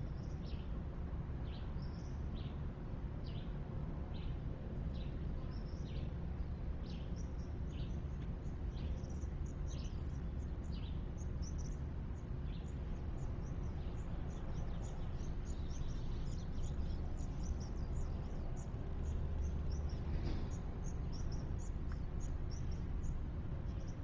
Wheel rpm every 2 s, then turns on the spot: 0, 0, 0, 0, 0, 0, 0, 0, 0, 0, 0, 0.
none